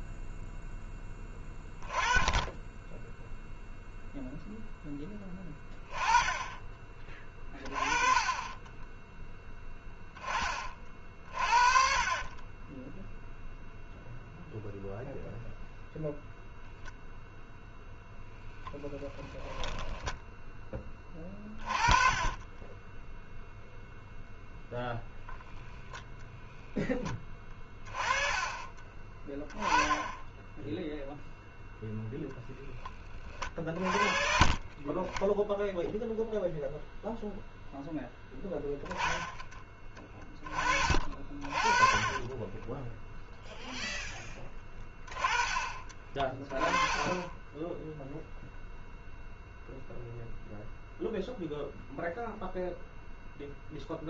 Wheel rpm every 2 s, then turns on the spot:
10, 10, 0, 20, 10, 30, 20, 0, 0, 10, 10, 10, 0, 10, 20, 0, 10, 30, 0, 10, 30, 10, 20, 20, 0, 0, 0.
8-10 12-14 18-20 22-24 28-30 42-44 46-48